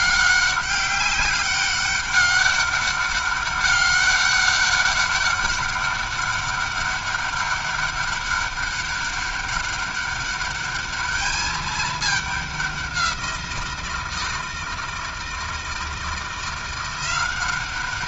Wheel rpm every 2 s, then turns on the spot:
200, 200, 200, 200, 200, 200, 200, 160, 170.
none